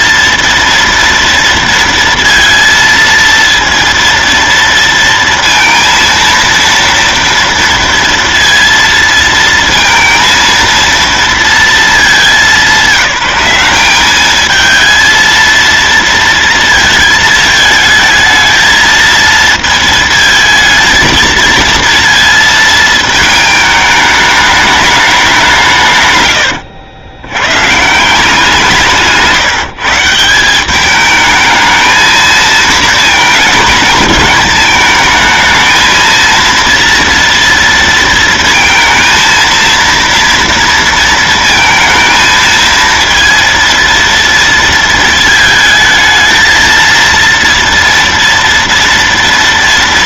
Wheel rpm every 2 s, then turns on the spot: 230, 230, 230, 230, 230, 220, 200, 210, 230, 220, 220, 230, 210, 140, 170, 160, 230, 210, 230, 230, 230, 220, 230, 220, 230.
26-28